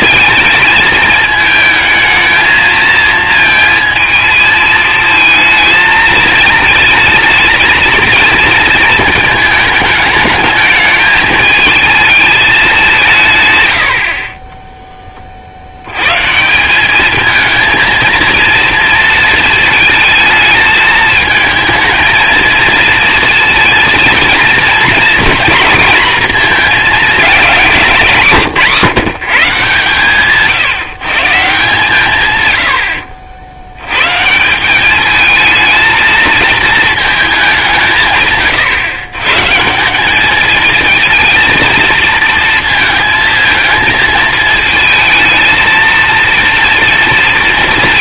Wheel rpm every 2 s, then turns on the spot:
220, 220, 220, 220, 230, 220, 190, 10, 180, 230, 220, 230, 230, 230, 170, 160, 100, 200, 220, 130, 220, 220, 220, 230.
14-16